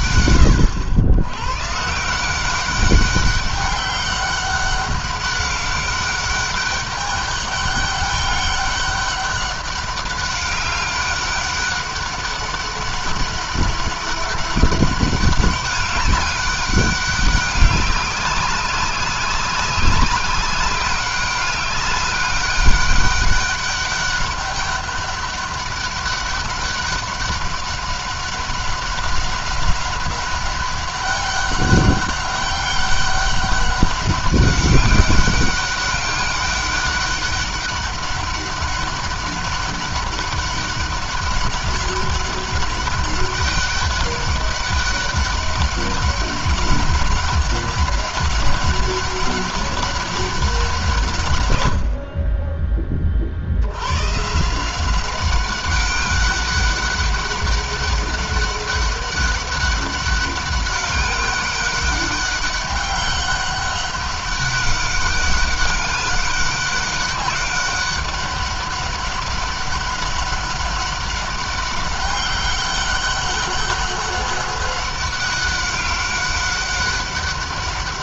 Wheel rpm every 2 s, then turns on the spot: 90, 190, 200, 200, 200, 200, 200, 200, 200, 190, 200, 200, 200, 200, 190, 200, 200, 200, 200, 200, 200, 200, 200, 200, 200, 170, 30, 180, 200, 200, 200, 200, 200, 200, 200, 200, 200, 200, 200.
none